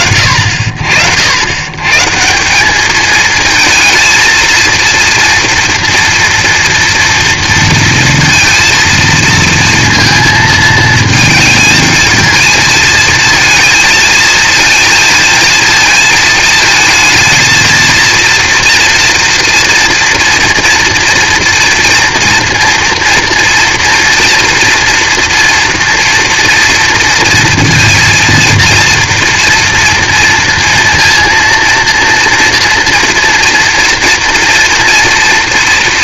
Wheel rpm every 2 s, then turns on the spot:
90, 220, 230, 230, 230, 220, 220, 220, 220, 230, 240, 230, 230, 230, 230, 230, 230, 230.
none